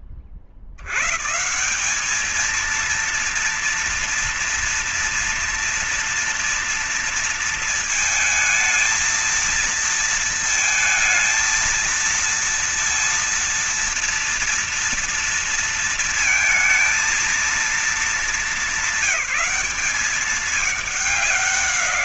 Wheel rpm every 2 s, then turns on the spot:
50, 230, 230, 230, 220, 220, 230, 230, 230, 200, 200.
none